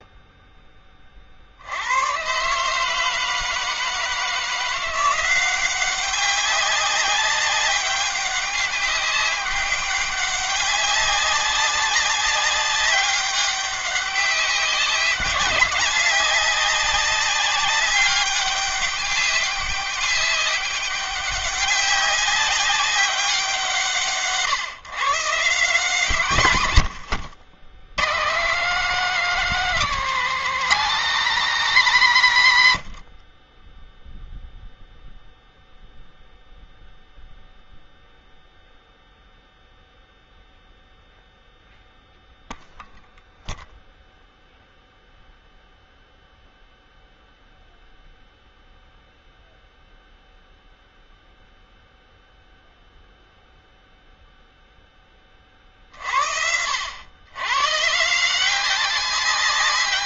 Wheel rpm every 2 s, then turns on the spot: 20, 150, 170, 190, 200, 200, 200, 190, 190, 200, 200, 200, 140, 140, 210, 240, 110, 0, 0, 0, 0, 0, 0, 0, 0, 0, 0, 10, 80, 190.
none